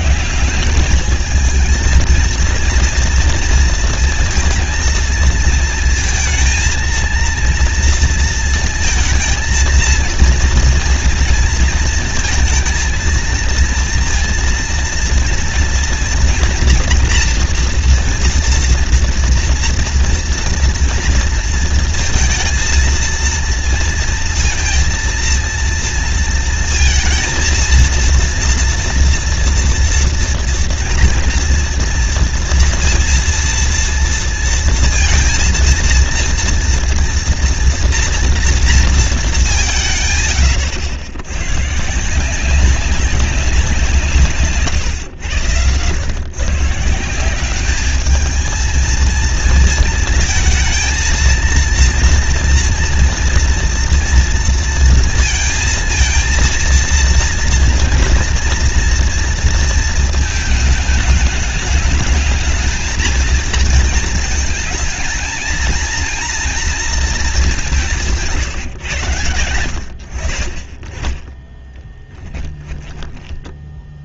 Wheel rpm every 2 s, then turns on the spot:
190, 230, 230, 230, 230, 230, 230, 230, 230, 230, 230, 230, 230, 230, 230, 230, 230, 230, 230, 230, 110, 190, 140, 140, 220, 230, 240, 230, 230, 230, 220, 220, 220, 240, 150, 30, 10.
44-46 72-74